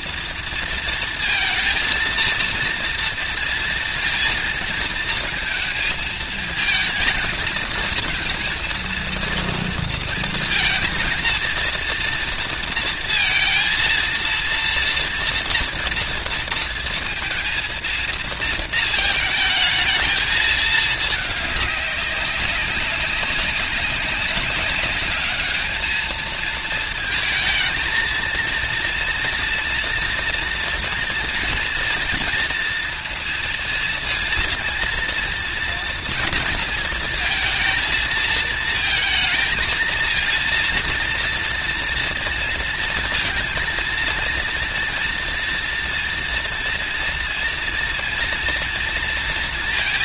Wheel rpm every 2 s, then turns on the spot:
230, 230, 230, 220, 230, 230, 230, 230, 230, 230, 220, 190, 190, 220, 230, 240, 230, 230, 230, 230, 230, 230, 230, 230, 240.
none